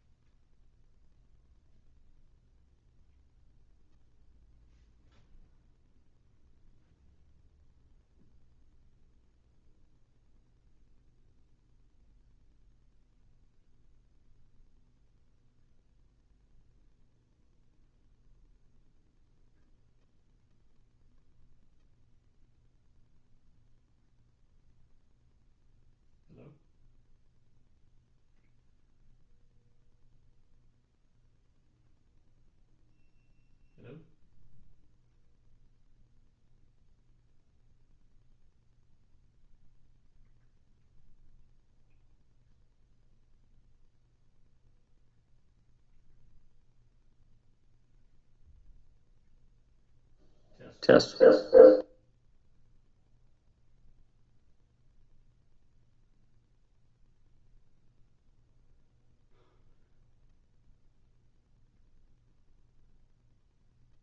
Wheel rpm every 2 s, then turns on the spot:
0, 0, 0, 0, 0, 0, 0, 0, 0, 0, 0, 0, 0, 0, 0, 0, 0, 0, 0, 0, 0, 0, 0, 0, 0, 0, 0, 0, 0, 0, 0, 0.
none